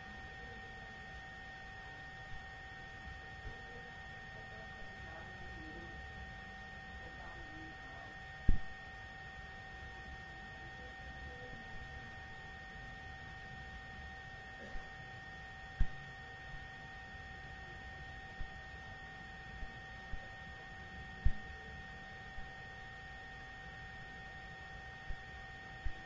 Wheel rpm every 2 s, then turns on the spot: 0, 0, 0, 0, 0, 0, 0, 0, 0, 0, 0, 0, 0.
none